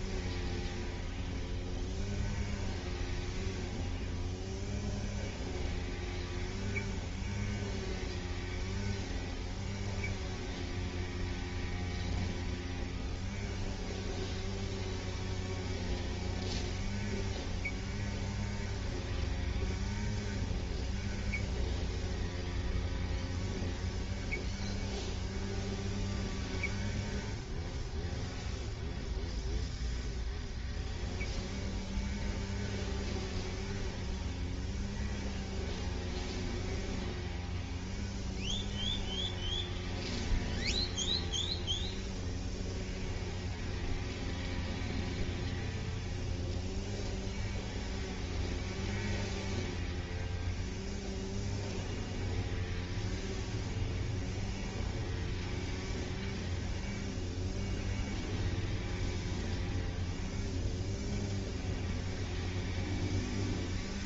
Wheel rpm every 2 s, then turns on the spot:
0, 0, 0, 0, 0, 0, 0, 0, 0, 0, 0, 0, 0, 0, 0, 0, 0, 0, 0, 0, 0, 0, 0, 0, 0, 0, 0, 0, 0, 0, 0, 0.
none